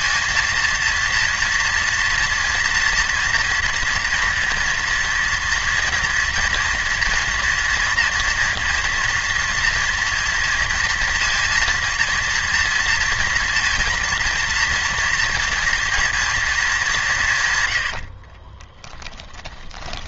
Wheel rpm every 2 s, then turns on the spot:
230, 230, 230, 230, 230, 230, 230, 230, 220, 30.
18-20